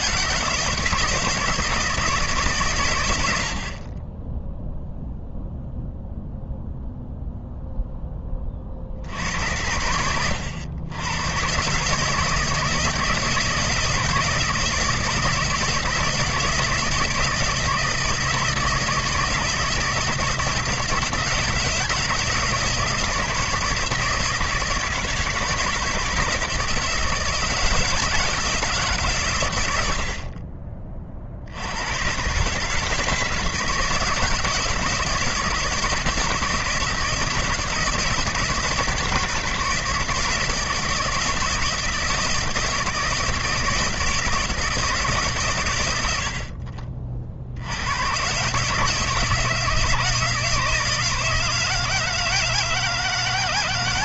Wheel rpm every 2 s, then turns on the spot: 160, 110, 0, 0, 60, 100, 160, 160, 160, 160, 170, 160, 160, 160, 140, 40, 150, 160, 160, 160, 170, 170, 160, 40, 150, 160, 160.
none